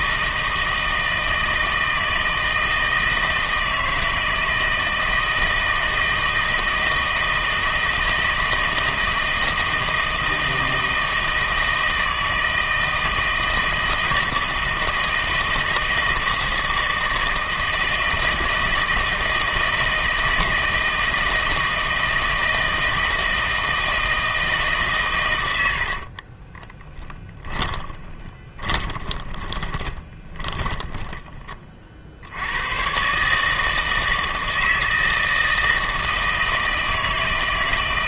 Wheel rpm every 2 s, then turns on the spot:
160, 160, 160, 160, 160, 160, 160, 160, 160, 160, 160, 160, 150, 20, 20, 20, 100, 160, 160.
26-32